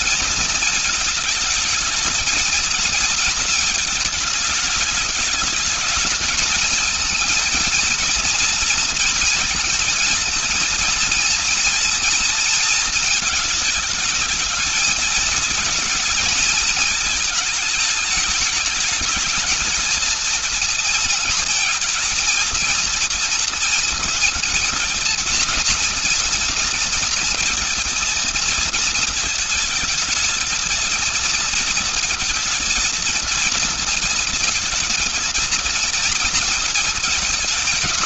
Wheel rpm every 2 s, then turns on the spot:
220, 230, 210, 220, 230, 230, 220, 220, 220, 210, 220, 230, 220, 230, 220, 220, 230, 230, 220.
none